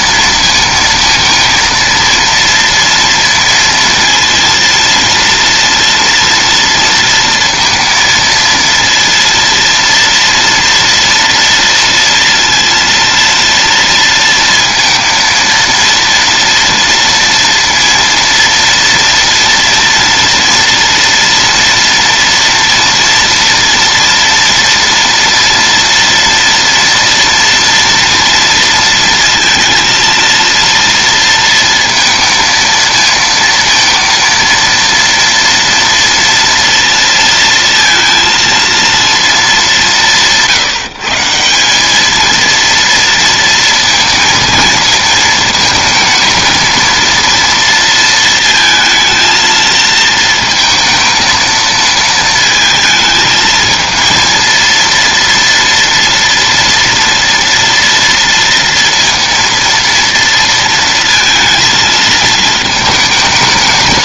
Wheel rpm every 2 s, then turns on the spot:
230, 230, 230, 230, 230, 230, 230, 230, 230, 230, 230, 230, 230, 230, 230, 230, 230, 230, 230, 230, 170, 230, 230, 220, 230, 230, 220, 230, 230, 230, 230, 220.
none